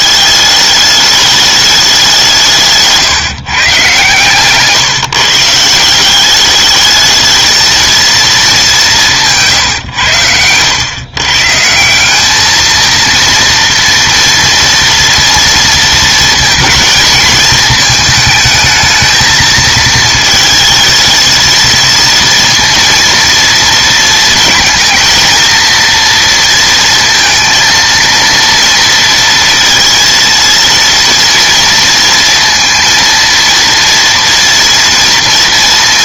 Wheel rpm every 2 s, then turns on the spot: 210, 160, 140, 210, 210, 100, 220, 230, 220, 220, 220, 230, 230, 230, 230, 230, 230, 230.
none